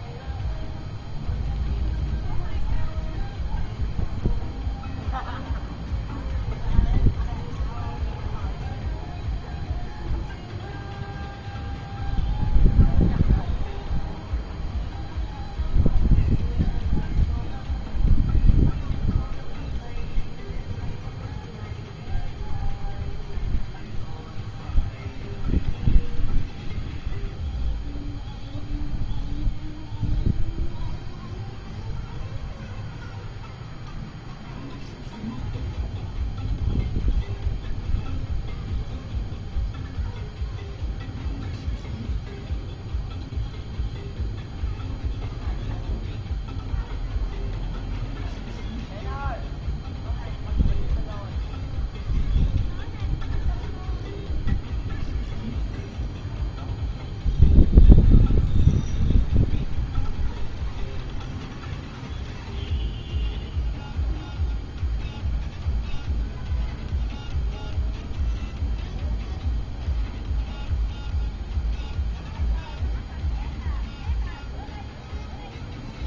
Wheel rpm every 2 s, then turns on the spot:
0, 0, 0, 0, 0, 0, 0, 0, 0, 0, 0, 0, 0, 0, 0, 0, 0, 0, 0, 0, 0, 0, 0, 0, 0, 0, 0, 0, 0, 0, 0, 0, 0, 0, 0, 0, 0, 0.
none